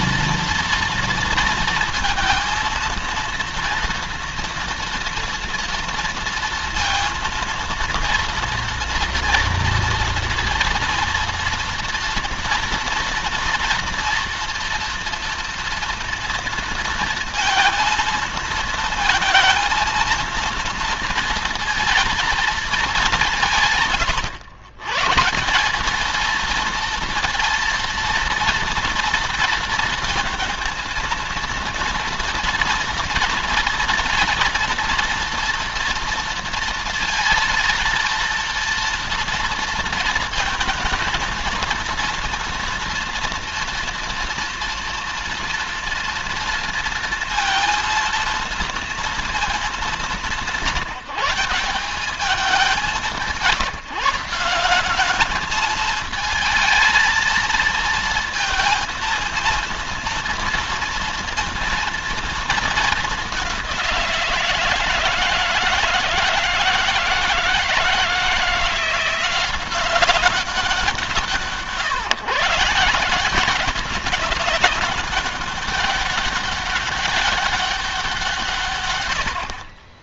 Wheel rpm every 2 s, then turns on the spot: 230, 230, 230, 230, 240, 230, 230, 230, 230, 230, 230, 200, 130, 230, 230, 230, 230, 230, 230, 230, 230, 230, 230, 230, 230, 170, 190, 190, 220, 230, 230, 210, 160, 160, 170, 180, 160, 190, 200, 110.
none